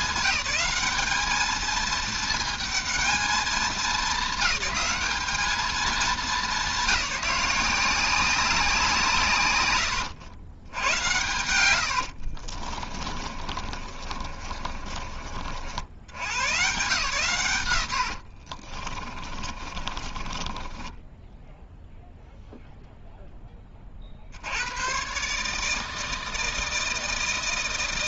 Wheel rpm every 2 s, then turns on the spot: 190, 220, 220, 190, 180, 100, 20, 30, 150, 30, 20, 0, 80, 160.
12-16 18-22